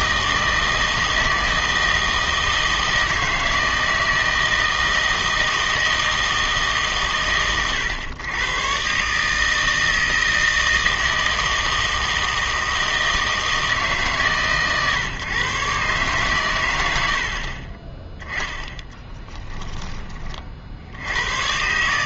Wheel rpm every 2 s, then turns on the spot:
160, 160, 160, 150, 120, 160, 160, 120, 100, 10, 60.
none